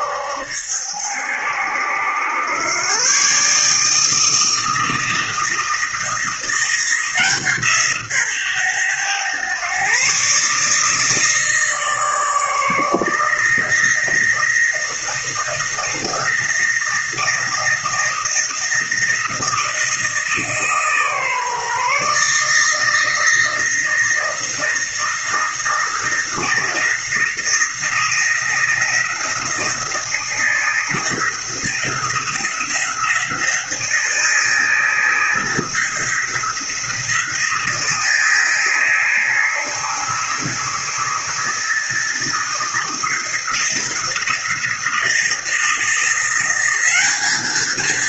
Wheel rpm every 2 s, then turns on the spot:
70, 100, 160, 170, 130, 140, 150, 160, 160, 160, 160, 150, 160, 160, 170, 160, 170, 160, 170, 160, 160, 160, 160, 180.
none